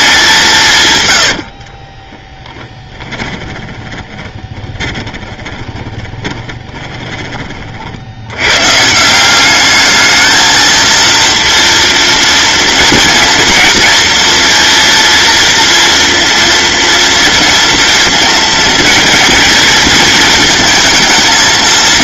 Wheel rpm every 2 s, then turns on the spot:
150, 10, 20, 20, 140, 220, 230, 230, 230, 220, 220.
2-8